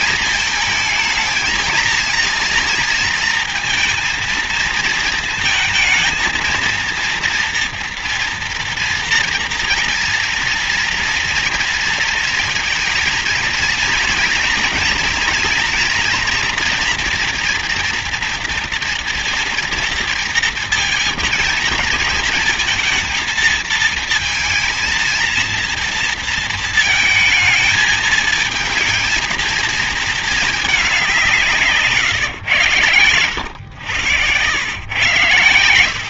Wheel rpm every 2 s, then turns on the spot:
230, 230, 230, 230, 230, 230, 230, 230, 240, 230, 230, 230, 230, 230, 220, 220, 120, 100.
32-34